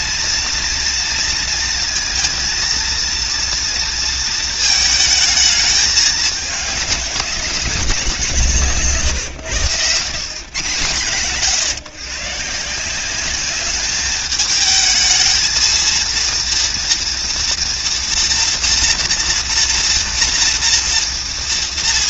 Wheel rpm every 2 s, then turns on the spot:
230, 230, 220, 200, 150, 120, 180, 220, 230, 230, 230.
none